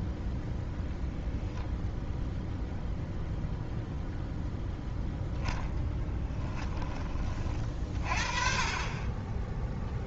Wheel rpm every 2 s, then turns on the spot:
0, 0, 0, 10, 30.
none